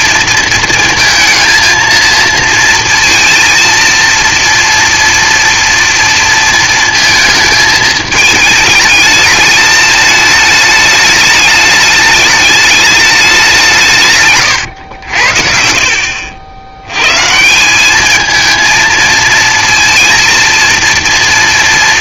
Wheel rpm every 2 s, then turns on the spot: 230, 230, 240, 230, 210, 210, 210, 90, 90, 220, 230.
none